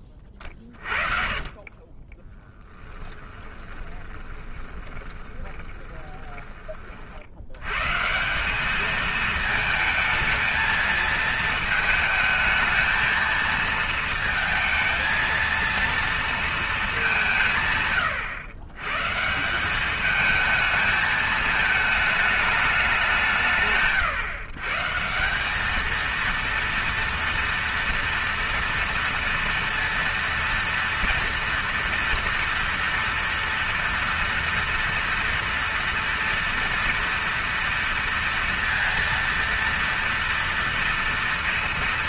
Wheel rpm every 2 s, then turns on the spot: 40, 20, 20, 30, 200, 220, 220, 230, 220, 120, 220, 210, 120, 230, 230, 230, 240, 230, 230, 230, 230.
0-6